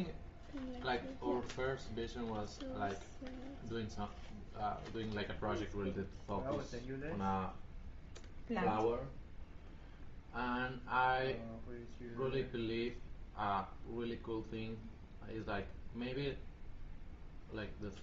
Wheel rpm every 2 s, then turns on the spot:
0, 0, 0, 0, 0, 0, 0, 0, 0.
none